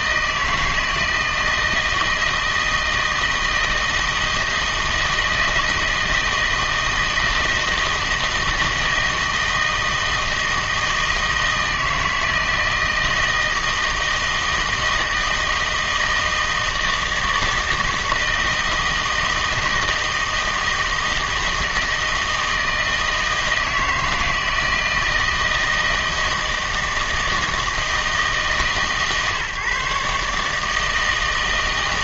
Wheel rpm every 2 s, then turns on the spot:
160, 160, 160, 160, 160, 160, 160, 160, 160, 160, 160, 160, 160, 160, 150, 160.
none